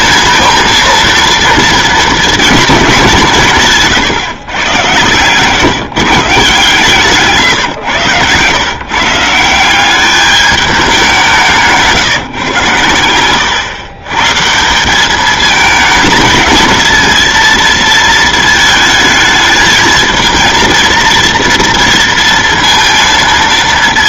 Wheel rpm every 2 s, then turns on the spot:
230, 220, 110, 160, 140, 200, 110, 160, 220, 220, 230, 230.
none